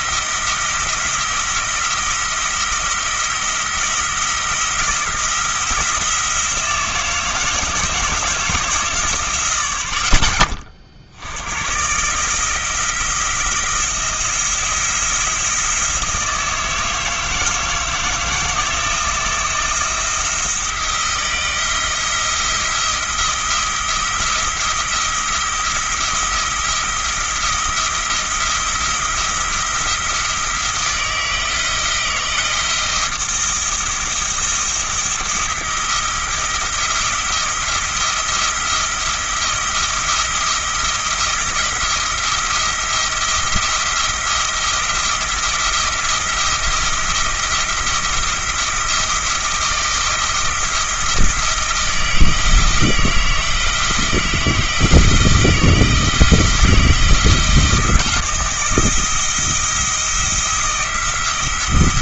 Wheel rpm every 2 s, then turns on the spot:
170, 170, 170, 160, 150, 60, 170, 170, 160, 160, 170, 170, 170, 170, 170, 160, 170, 170, 170, 170, 170, 170, 170, 170, 170, 170, 160, 160, 160, 170, 170.
none